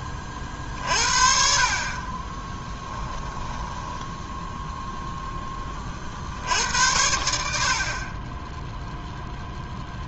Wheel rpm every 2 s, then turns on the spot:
30, 20, 10, 60, 10.
2-4